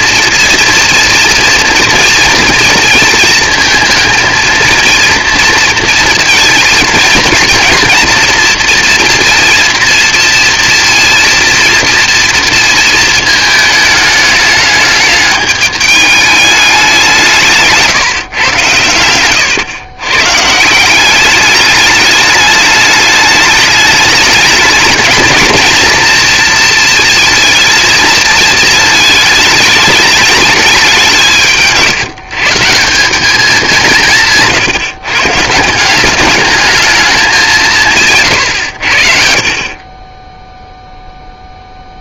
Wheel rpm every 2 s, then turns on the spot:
230, 230, 230, 230, 230, 230, 230, 210, 200, 120, 150, 210, 210, 230, 220, 210, 160, 150, 210, 110, 0.
none